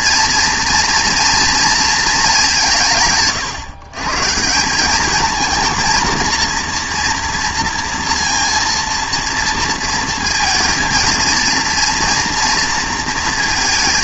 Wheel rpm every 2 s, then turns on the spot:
230, 180, 170, 230, 230, 230, 230.
none